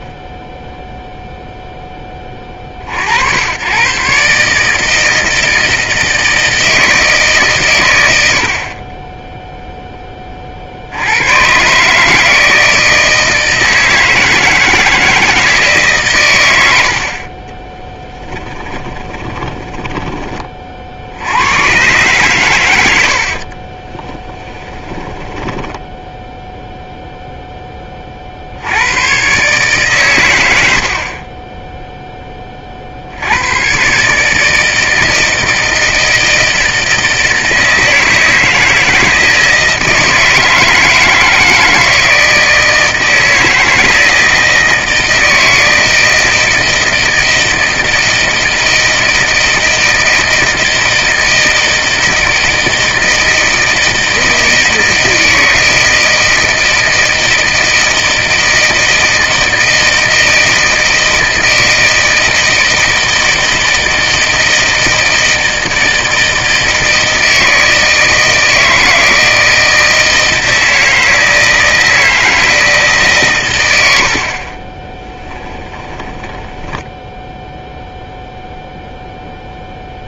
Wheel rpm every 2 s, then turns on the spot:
0, 40, 150, 160, 40, 60, 160, 160, 80, 20, 40, 100, 10, 0, 80, 70, 40, 160, 160, 160, 160, 160, 160, 160, 160, 160, 160, 160, 160, 160, 160, 160, 160, 160, 160, 160, 150, 20, 10, 0.
18-20 24-26 74-76